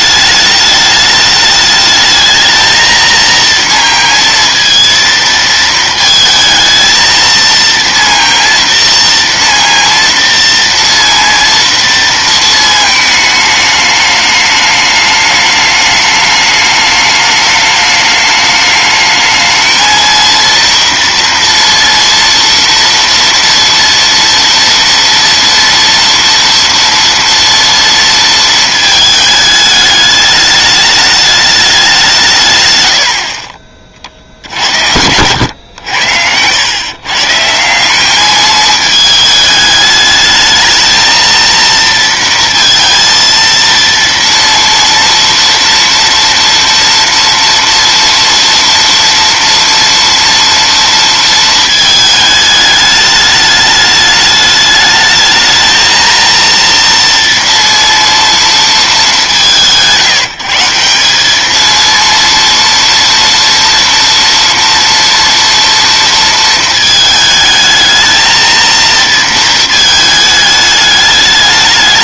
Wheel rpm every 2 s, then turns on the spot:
210, 230, 230, 230, 230, 230, 220, 210, 210, 210, 230, 230, 230, 230, 220, 210, 100, 80, 120, 210, 220, 230, 230, 230, 230, 230, 210, 210, 230, 190, 180, 230, 230, 220, 230, 210.
none